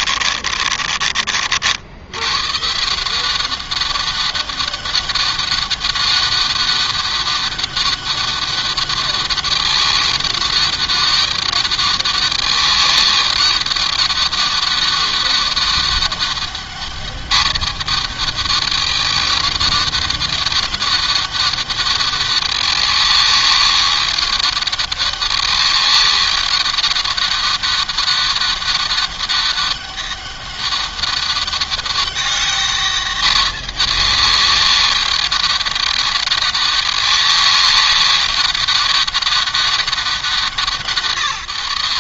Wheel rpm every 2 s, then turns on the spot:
40, 160, 200, 200, 200, 200, 200, 200, 210, 200, 200, 200, 200, 200, 200, 200, 210, 200, 200, 200, 180.
none